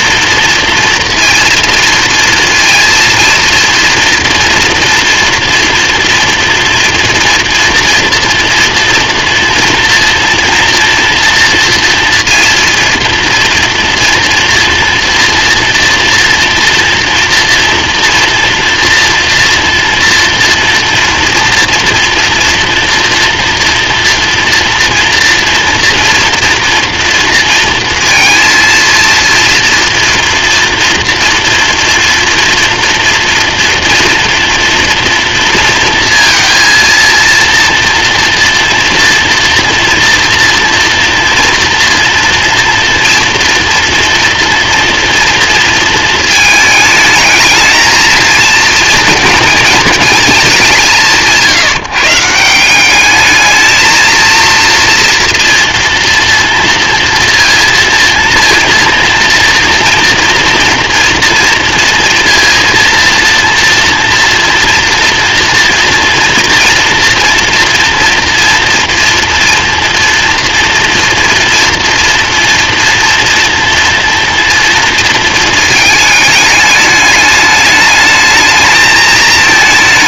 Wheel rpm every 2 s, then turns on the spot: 230, 230, 230, 230, 230, 230, 230, 240, 230, 230, 240, 230, 240, 230, 230, 240, 230, 230, 230, 240, 230, 230, 230, 220, 230, 160, 220, 230, 230, 230, 240, 230, 240, 230, 230, 230, 240, 230, 210, 200.
none